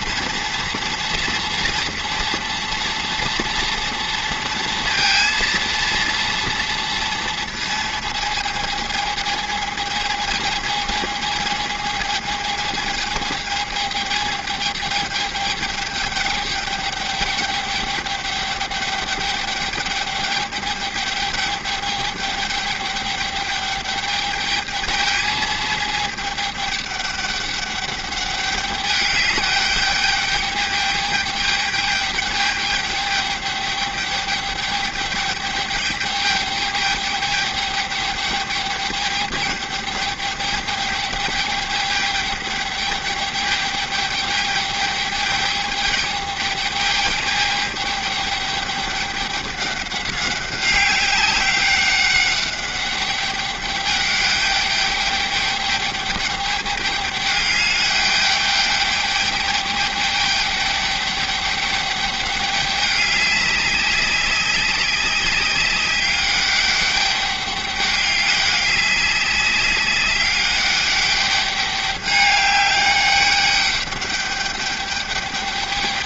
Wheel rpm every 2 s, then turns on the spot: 230, 240, 230, 230, 220, 220, 220, 210, 210, 200, 210, 210, 210, 210, 200, 210, 210, 210, 210, 210, 210, 210, 210, 210, 200, 200, 200, 200, 200, 210, 200, 200, 200, 200, 200, 200, 200, 200.
none